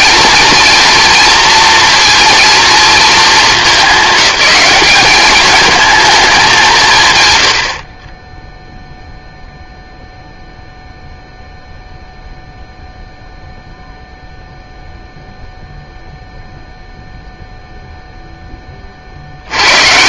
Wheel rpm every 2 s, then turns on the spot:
230, 230, 200, 170, 0, 0, 0, 0, 0, 30.
none